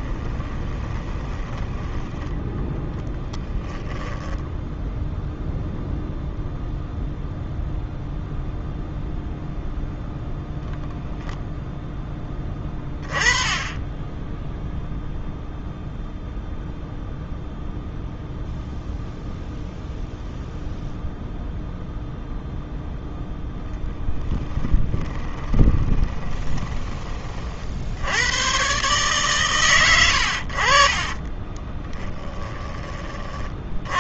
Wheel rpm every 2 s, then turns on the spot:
20, 10, 0, 0, 0, 0, 20, 0, 0, 0, 0, 0, 20, 20, 130, 40, 30.
0-2 24-26